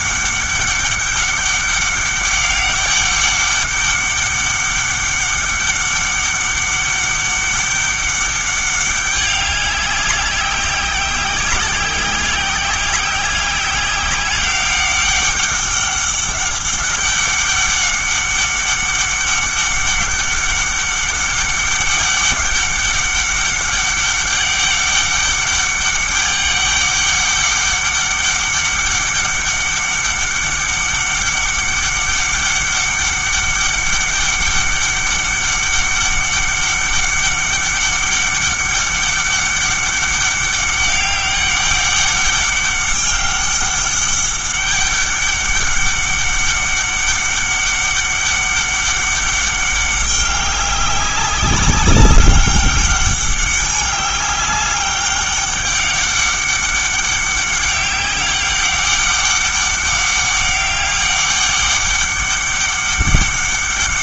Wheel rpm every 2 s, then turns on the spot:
200, 200, 200, 200, 200, 190, 190, 190, 200, 200, 200, 200, 200, 200, 200, 200, 200, 200, 200, 200, 200, 200, 200, 200, 200, 190, 200, 200, 200, 200, 200, 200.
none